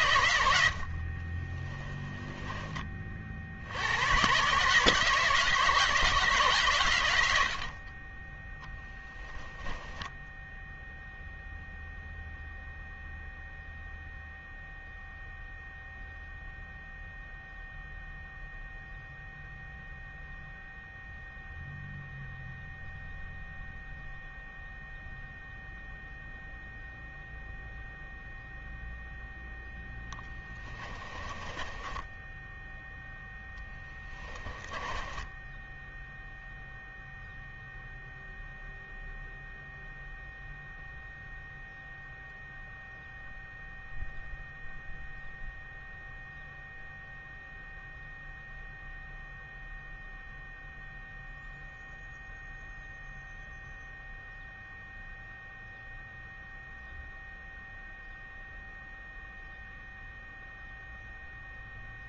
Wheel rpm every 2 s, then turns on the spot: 70, 20, 150, 110, 10, 0, 0, 0, 0, 0, 0, 0, 0, 0, 0, 20, 0, 10, 0, 0, 0, 0, 0, 0, 0, 0, 0, 0, 0, 0, 0.
0-2 8-10 30-32 34-36